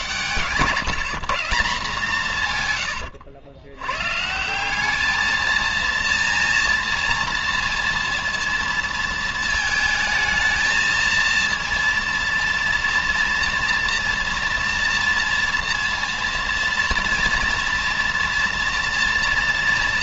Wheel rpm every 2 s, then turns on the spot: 140, 150, 160, 230, 230, 220, 230, 230, 230, 230.
none